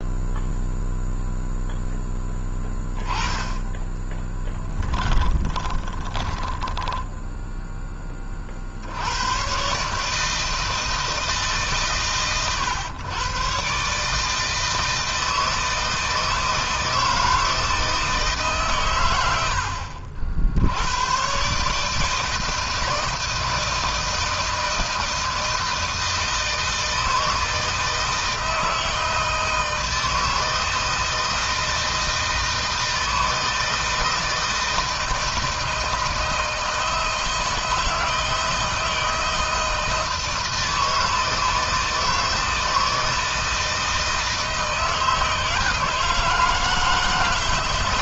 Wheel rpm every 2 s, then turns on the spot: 0, 20, 10, 10, 80, 160, 120, 160, 160, 110, 100, 160, 170, 160, 160, 160, 160, 160, 160, 170, 160, 160, 160, 160.
4-8